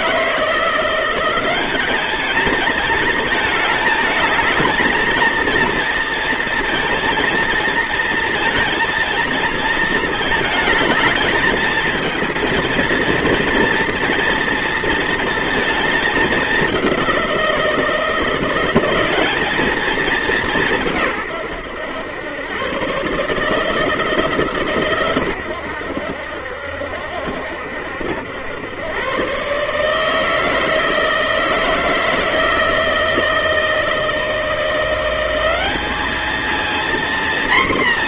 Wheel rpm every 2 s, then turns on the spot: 170, 220, 220, 230, 230, 220, 230, 230, 210, 170, 190, 110, 150, 70, 90, 160, 160, 170, 220.
none